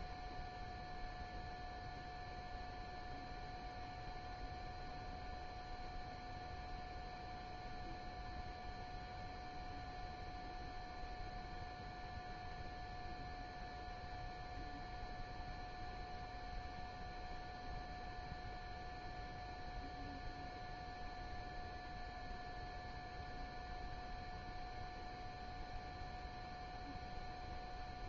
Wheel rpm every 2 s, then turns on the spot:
0, 0, 0, 0, 0, 0, 0, 0, 0, 0, 0, 0, 0, 0.
none